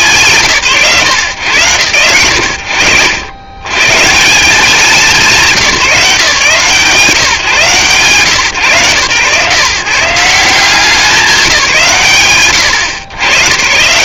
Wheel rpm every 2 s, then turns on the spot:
140, 90, 190, 140, 140, 180, 90.
none